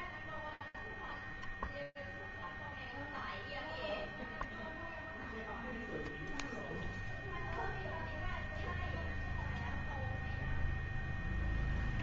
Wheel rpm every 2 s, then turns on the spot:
0, 0, 0, 0, 0, 0.
none